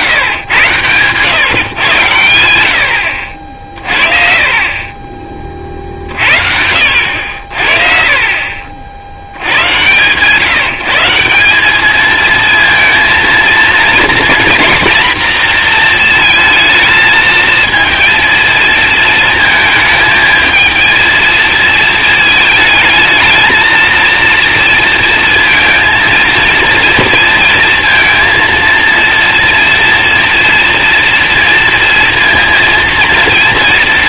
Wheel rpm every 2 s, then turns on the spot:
130, 60, 30, 70, 90, 180, 230, 240, 230, 230, 220, 220, 230, 230, 230, 230, 230.
none